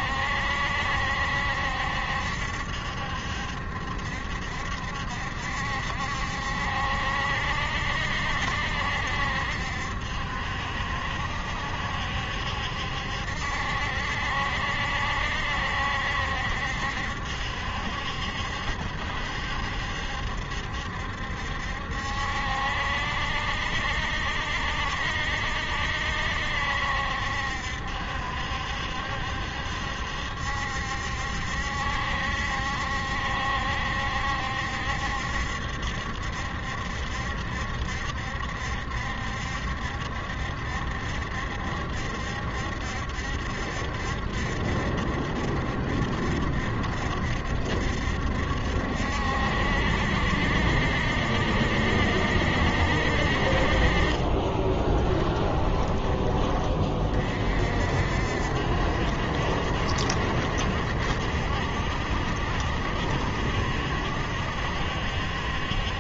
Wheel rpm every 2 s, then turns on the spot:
70, 70, 70, 70, 70, 70, 70, 70, 70, 70, 70, 70, 70, 70, 70, 70, 70, 70, 70, 70, 70, 70, 70, 70, 70, 70, 60, 10, 30, 60, 60, 70, 70.
54-56